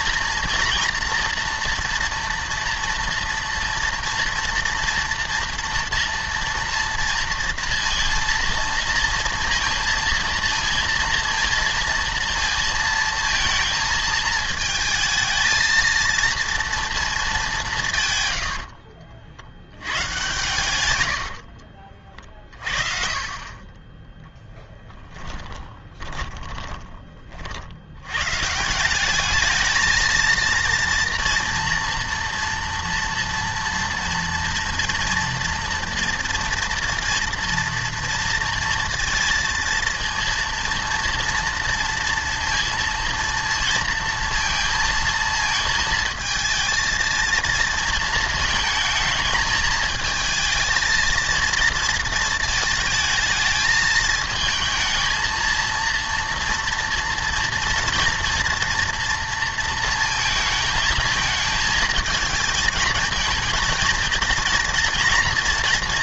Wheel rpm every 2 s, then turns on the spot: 240, 230, 230, 230, 230, 230, 230, 220, 230, 70, 100, 30, 10, 20, 160, 230, 230, 230, 230, 230, 230, 230, 230, 230, 220, 220, 220, 220, 230, 230, 220, 220, 240.
18-20 24-28